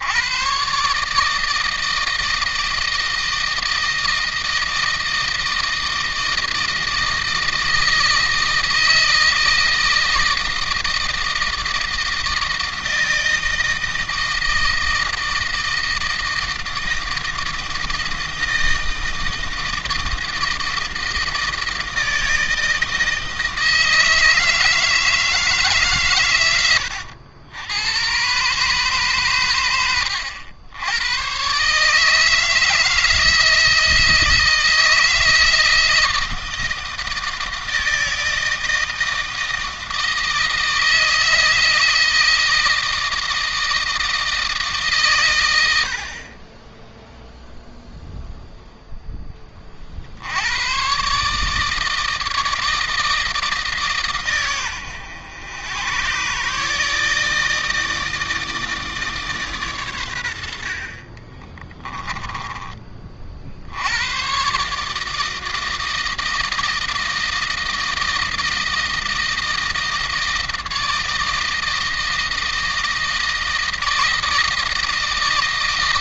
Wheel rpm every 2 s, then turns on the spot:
140, 160, 160, 160, 160, 160, 160, 160, 160, 160, 160, 160, 160, 90, 130, 100, 160, 160, 160, 160, 160, 160, 140, 10, 10, 120, 160, 110, 150, 150, 50, 40, 150, 160, 160, 160, 160, 160.
60-62